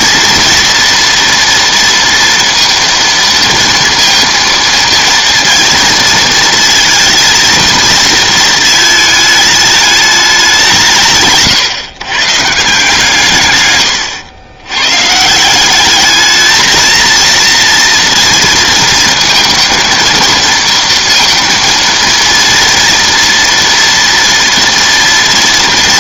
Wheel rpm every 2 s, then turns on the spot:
230, 230, 230, 220, 220, 150, 160, 120, 220, 230, 230, 230, 230.
none